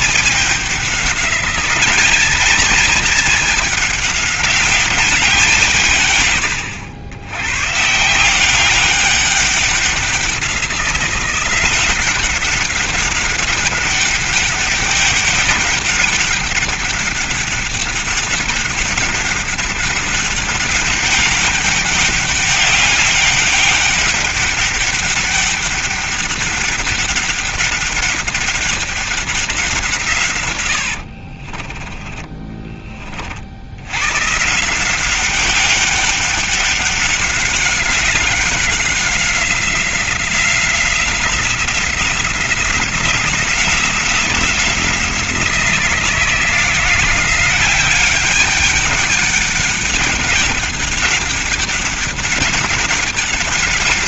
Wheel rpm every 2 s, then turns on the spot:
200, 220, 200, 100, 190, 180, 200, 200, 200, 200, 200, 200, 200, 200, 200, 90, 30, 170, 200, 190, 180, 180, 170, 170, 200, 200, 200.
none